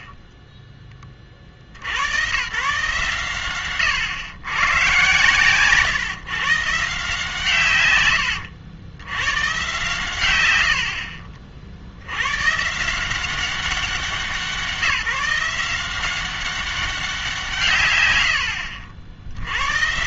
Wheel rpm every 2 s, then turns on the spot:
20, 120, 130, 130, 90, 100, 140, 180, 190, 60.
0-2